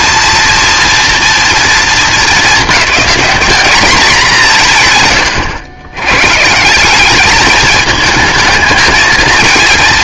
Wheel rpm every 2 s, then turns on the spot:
230, 210, 150, 180, 220.
none